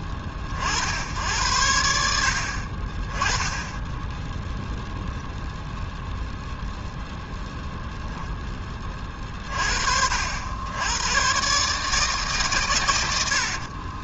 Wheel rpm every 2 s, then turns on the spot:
30, 60, 0, 0, 10, 80, 130.
none